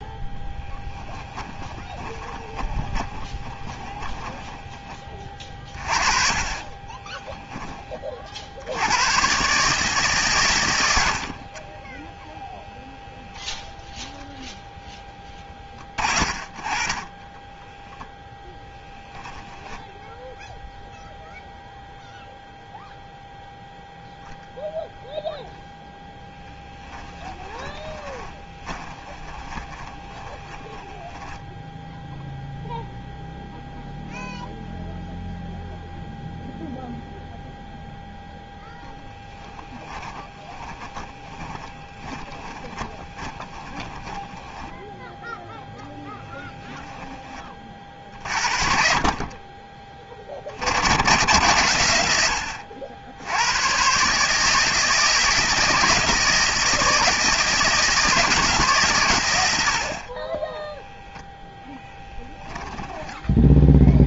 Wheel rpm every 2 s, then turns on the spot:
0, 20, 10, 30, 70, 120, 0, 0, 30, 10, 0, 0, 0, 10, 20, 20, 0, 0, 0, 0, 20, 20, 10, 10, 50, 50, 70, 150, 160, 150, 10, 10.
2-8 28-32 40-48 60-64